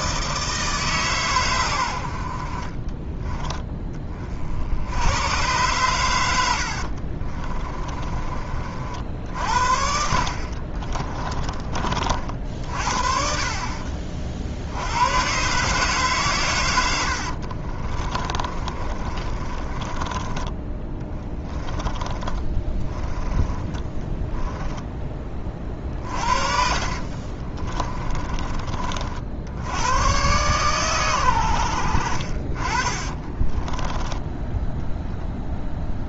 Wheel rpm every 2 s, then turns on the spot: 160, 40, 70, 80, 40, 50, 50, 70, 110, 30, 10, 20, 10, 60, 30, 120, 40, 10.
6-8 10-12 18-20 22-28